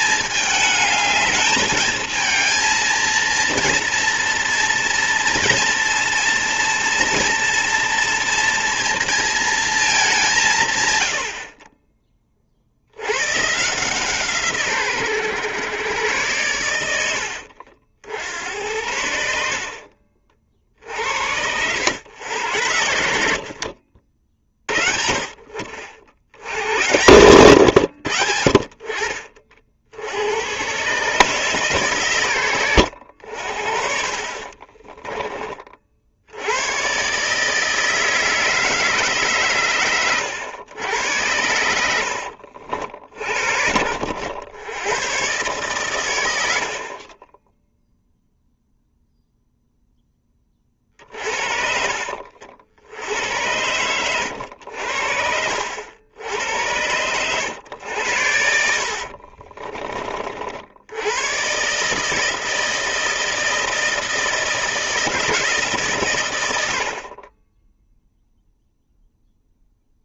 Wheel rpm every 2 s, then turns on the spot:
210, 220, 230, 230, 230, 130, 60, 140, 90, 80, 50, 100, 30, 90, 60, 110, 100, 30, 100, 160, 100, 60, 100, 70, 0, 30, 80, 80, 80, 60, 70, 160, 160, 80, 0.
34-36 42-44 50-52 58-60